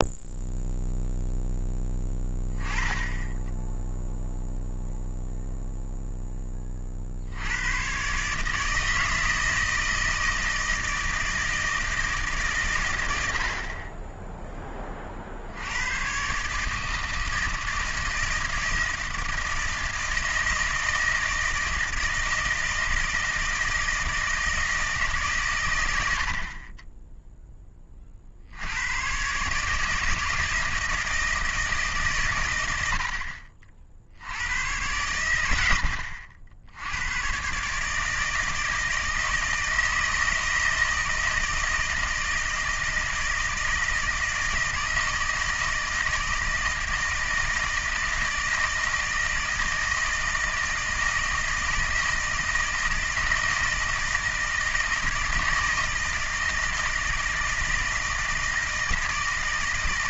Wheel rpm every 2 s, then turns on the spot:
0, 10, 0, 20, 150, 160, 130, 10, 150, 160, 160, 160, 160, 40, 80, 160, 100, 90, 70, 160, 160, 160, 160, 160, 160, 160, 160, 160, 160, 160.
none